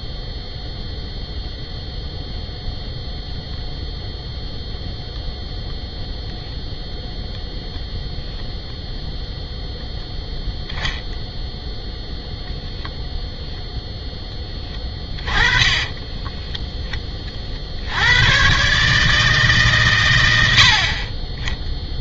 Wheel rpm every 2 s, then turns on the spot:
0, 0, 0, 0, 0, 0, 0, 10, 10, 140, 50.
20-22